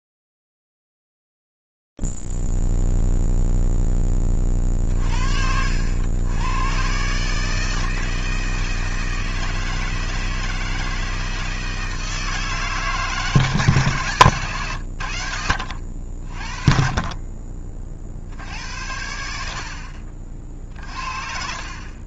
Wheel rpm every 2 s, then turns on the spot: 0, 0, 20, 90, 160, 160, 160, 120, 40, 60, 50.
14-16